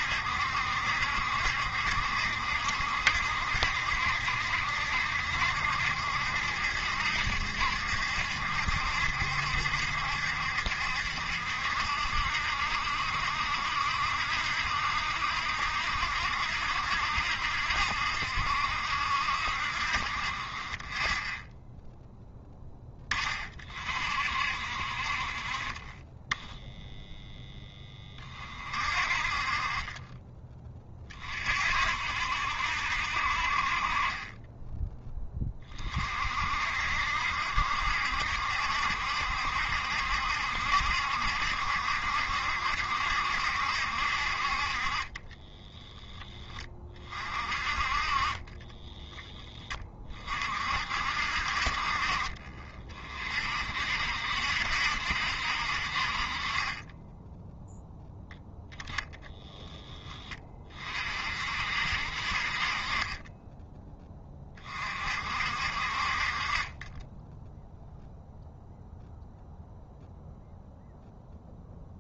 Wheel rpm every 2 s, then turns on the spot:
70, 70, 70, 70, 70, 70, 60, 60, 70, 60, 20, 10, 50, 10, 40, 30, 70, 10, 60, 70, 70, 70, 40, 20, 20, 50, 40, 70, 30, 10, 30, 40, 30, 30, 0, 0.
48-50